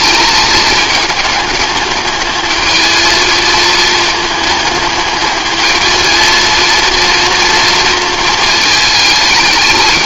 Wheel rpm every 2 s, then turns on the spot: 210, 220, 220, 230, 220.
none